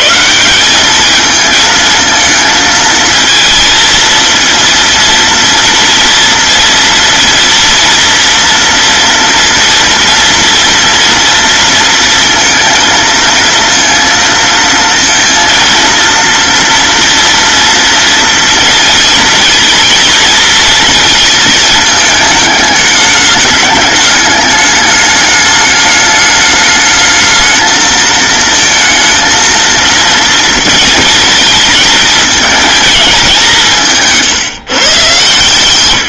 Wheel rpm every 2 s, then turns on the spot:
190, 220, 230, 230, 230, 230, 230, 230, 230, 230, 230, 220, 210, 210, 220, 230, 220, 150.
none